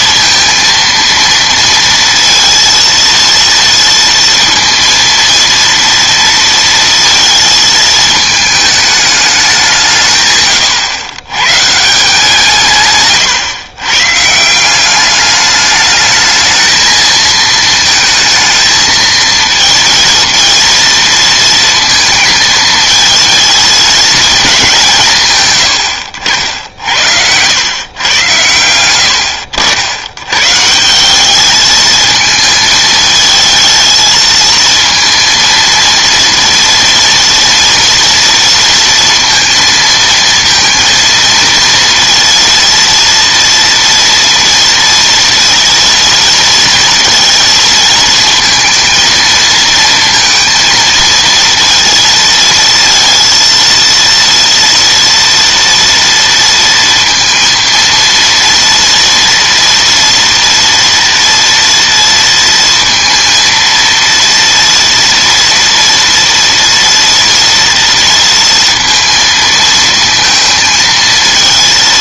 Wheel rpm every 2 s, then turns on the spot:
230, 230, 230, 230, 210, 130, 140, 180, 220, 220, 230, 220, 190, 70, 90, 150, 220, 230, 230, 230, 220, 230, 230, 230, 230, 230, 230, 230, 230, 230, 230, 230, 230, 230, 230, 230.
none